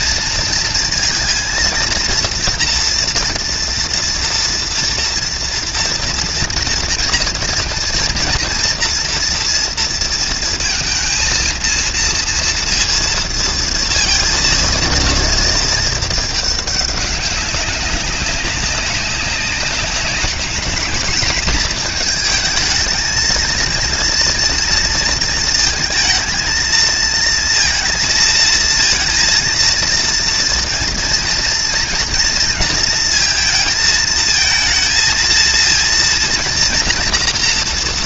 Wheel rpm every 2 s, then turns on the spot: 230, 240, 240, 230, 230, 230, 230, 230, 210, 190, 210, 220, 230, 220, 230, 230, 230, 220, 240.
none